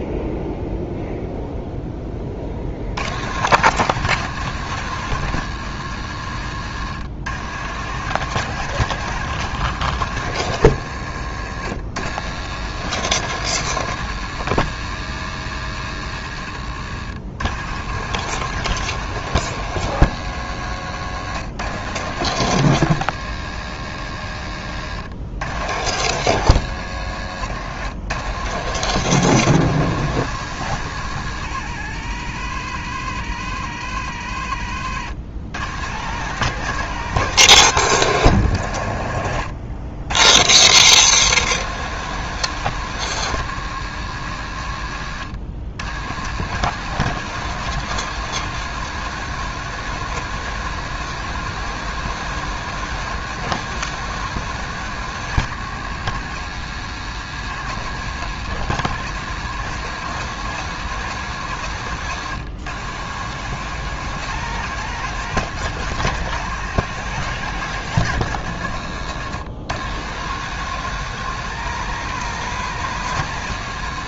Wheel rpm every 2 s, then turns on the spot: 0, 50, 120, 100, 130, 100, 110, 110, 70, 130, 100, 100, 70, 100, 110, 110, 70, 60, 130, 80, 110, 120, 90, 110, 130, 130, 130, 130, 120, 120, 130, 110, 130, 130, 90, 120, 130.
16-18 24-26 34-36